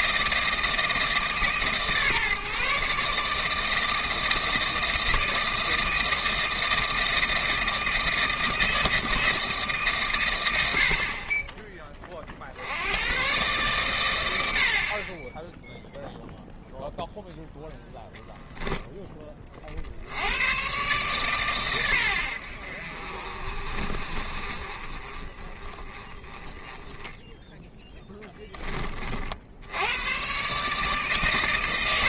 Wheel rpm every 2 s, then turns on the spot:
160, 150, 160, 160, 160, 80, 80, 60, 0, 10, 120, 70, 30, 10, 20, 140.
none